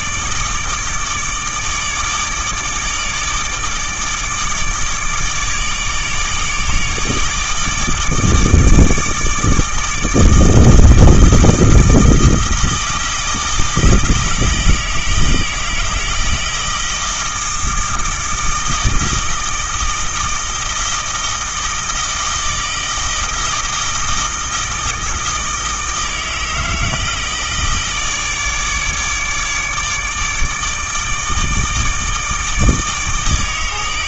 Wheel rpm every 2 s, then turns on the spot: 150, 150, 150, 150, 160, 160, 160, 160, 160, 160, 160, 160, 160, 160, 150, 160, 160.
none